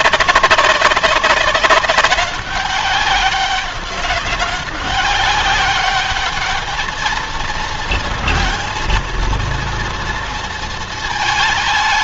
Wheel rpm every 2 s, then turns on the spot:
200, 200, 200, 210, 230, 230.
none